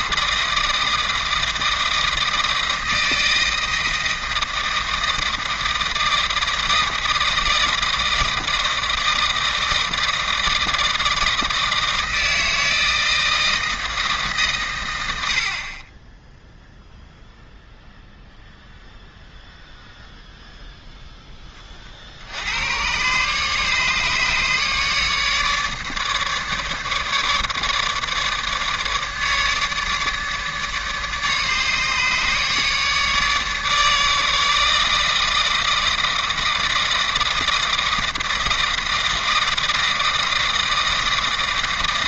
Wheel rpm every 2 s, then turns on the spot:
160, 160, 160, 160, 160, 160, 160, 110, 0, 0, 0, 100, 150, 150, 150, 150, 150, 160, 160, 160, 160.
none